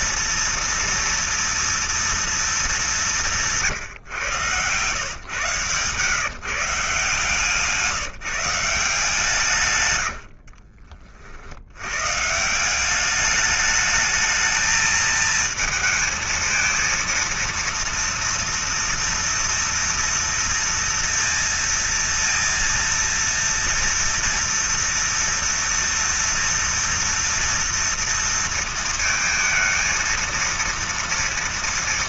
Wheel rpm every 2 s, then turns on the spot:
230, 230, 130, 140, 170, 80, 130, 220, 220, 230, 230, 230, 230, 230, 230, 230.
10-12